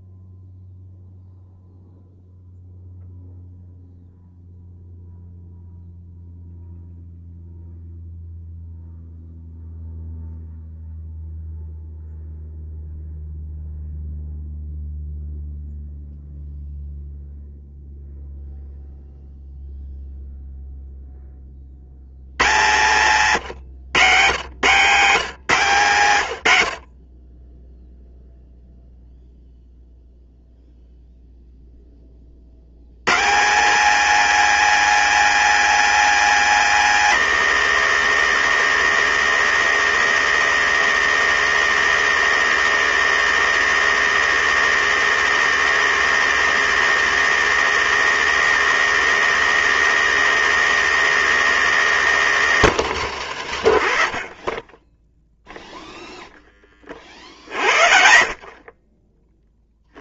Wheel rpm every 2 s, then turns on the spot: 0, 0, 0, 0, 0, 0, 0, 0, 0, 0, 0, 120, 140, 50, 0, 0, 110, 230, 220, 220, 220, 220, 220, 220, 230, 220, 170, 20, 20, 30.
22-24